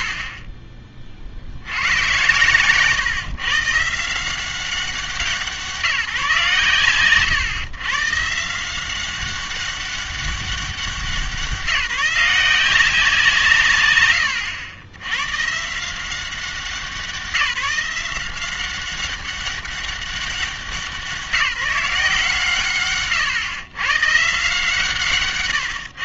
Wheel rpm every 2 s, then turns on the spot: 40, 120, 180, 140, 170, 190, 180, 100, 190, 190, 190, 130, 150.
0-2